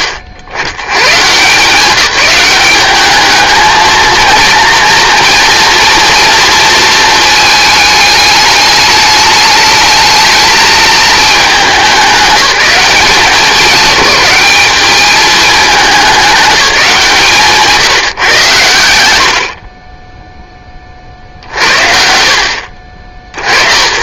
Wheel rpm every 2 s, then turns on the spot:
100, 210, 230, 230, 210, 220, 200, 200, 200, 90, 40, 60.
18-20